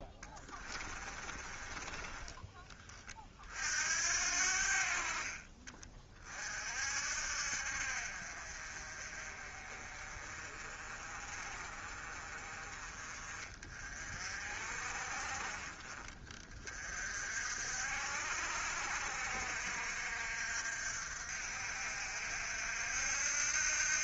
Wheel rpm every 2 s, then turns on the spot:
20, 20, 70, 40, 50, 40, 30, 40, 30, 60, 60, 60.
0-4